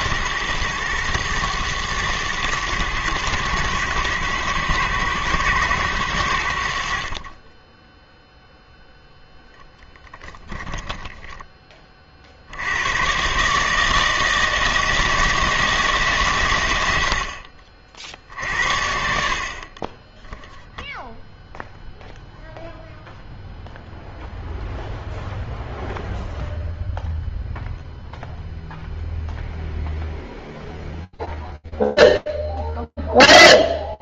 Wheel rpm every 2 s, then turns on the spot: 110, 110, 110, 60, 0, 10, 100, 160, 80, 70, 0, 0, 0, 0, 0, 0, 0.
10-12